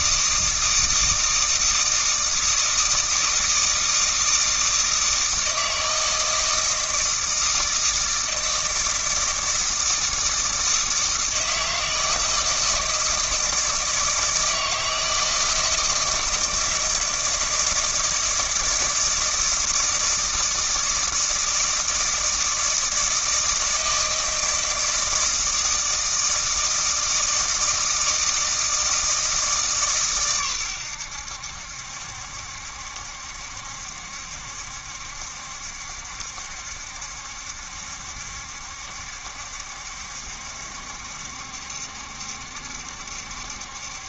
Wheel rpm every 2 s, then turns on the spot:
160, 160, 160, 160, 160, 160, 160, 160, 160, 160, 160, 160, 160, 160, 160, 120, 70, 70, 70, 70, 70, 70.
none